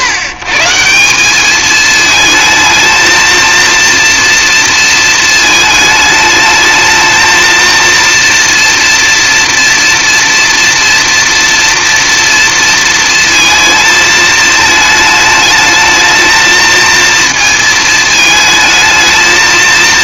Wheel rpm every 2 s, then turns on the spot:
130, 220, 230, 220, 230, 230, 230, 220, 230, 220.
none